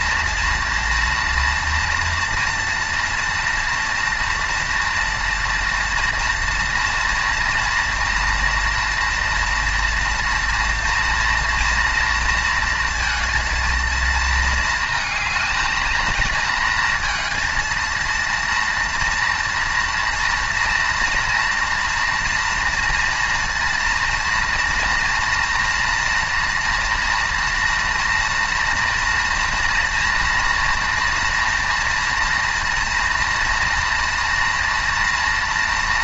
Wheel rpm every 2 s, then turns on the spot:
230, 230, 230, 230, 230, 230, 230, 220, 230, 230, 230, 230, 240, 230, 240, 240, 230, 230.
none